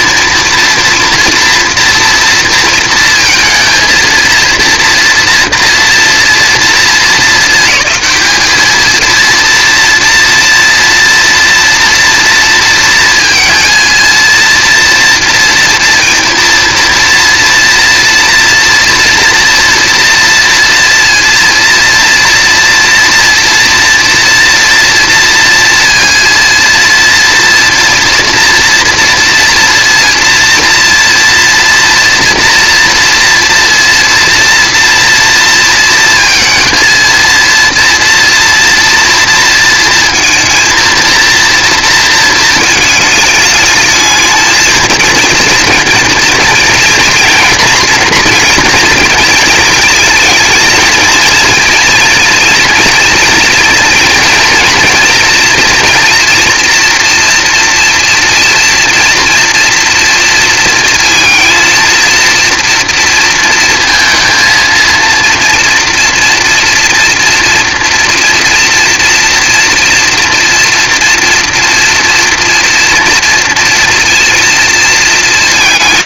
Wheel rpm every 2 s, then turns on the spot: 230, 230, 230, 220, 210, 230, 230, 230, 230, 240, 230, 240, 230, 230, 230, 240, 230, 230, 230, 230, 230, 220, 220, 230, 230, 230, 230, 230, 240, 230, 230, 230, 230, 230, 230, 230, 230, 230.
none